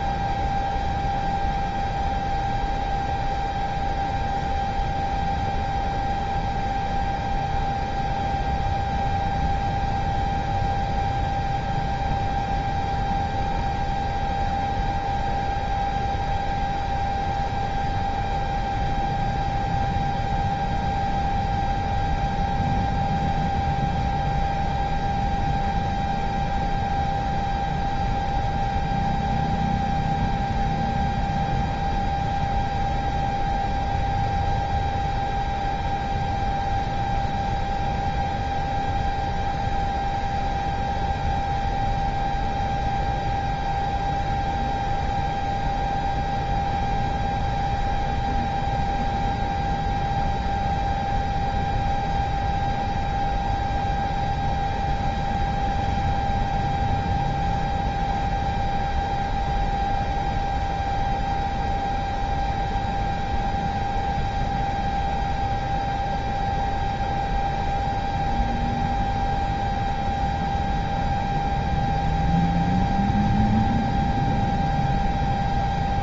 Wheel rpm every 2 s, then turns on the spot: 0, 0, 0, 0, 0, 0, 0, 0, 0, 0, 0, 0, 0, 0, 0, 0, 0, 0, 0, 0, 0, 0, 0, 0, 0, 0, 0, 0, 0, 0, 0, 0, 0, 0, 0, 0, 0, 0.
none